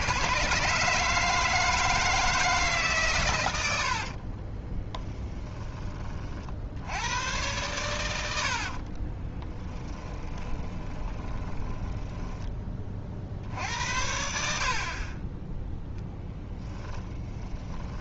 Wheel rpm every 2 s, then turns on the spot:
130, 140, 10, 90, 40, 20, 20, 50, 10.
4-6 8-12 16-18